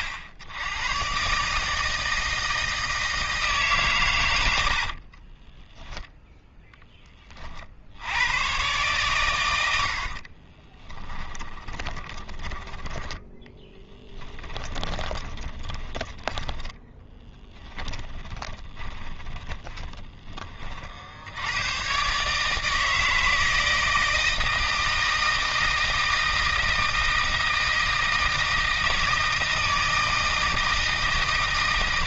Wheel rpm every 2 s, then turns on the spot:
90, 160, 80, 10, 110, 30, 10, 20, 10, 20, 40, 160, 160, 160, 160, 170.
4-6 10-20